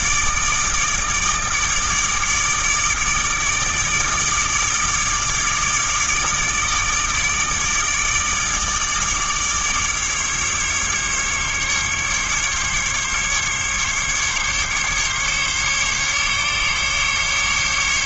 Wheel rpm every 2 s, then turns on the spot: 160, 160, 150, 150, 150, 140, 140, 140, 140.
none